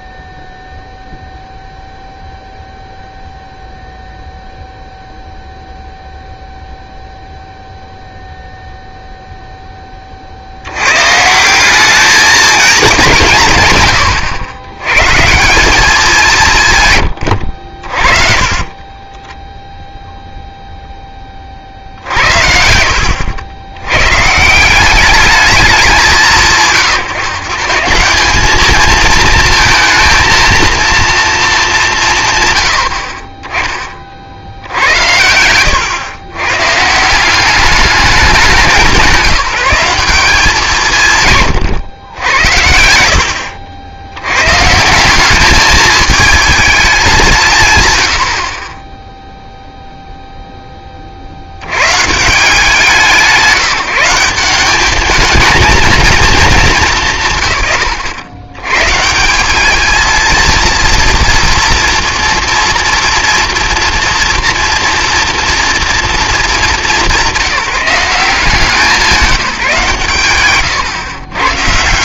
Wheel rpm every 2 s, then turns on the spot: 0, 0, 0, 0, 0, 90, 210, 100, 150, 30, 0, 80, 170, 160, 210, 230, 100, 70, 130, 200, 180, 80, 140, 210, 30, 10, 180, 190, 210, 120, 230, 240, 230, 210, 180, 120.
18-20 34-36 70-72